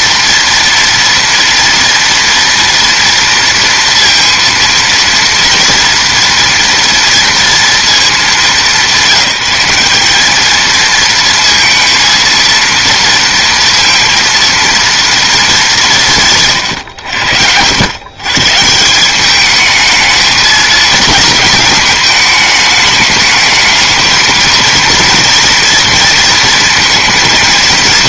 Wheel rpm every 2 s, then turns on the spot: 240, 230, 230, 230, 200, 220, 230, 230, 130, 150, 220, 210, 230, 230.
none